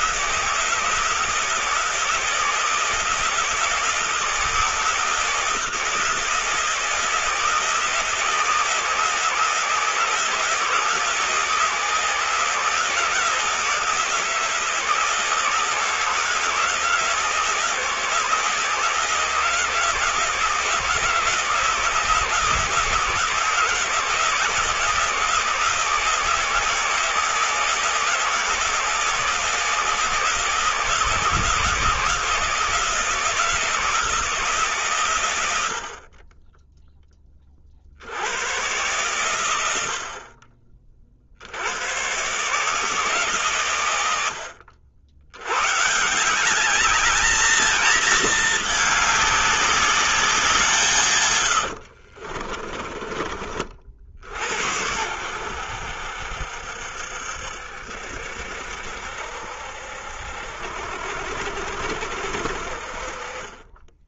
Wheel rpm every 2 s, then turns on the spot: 160, 160, 160, 160, 160, 160, 160, 160, 160, 160, 160, 160, 160, 160, 160, 160, 170, 150, 10, 120, 30, 140, 70, 190, 220, 170, 30, 80, 70, 60, 70, 50.
52-54